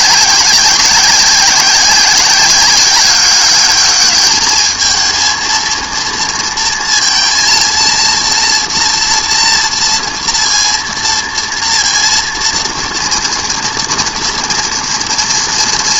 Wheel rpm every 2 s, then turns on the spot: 190, 190, 220, 230, 240, 230, 230, 230.
none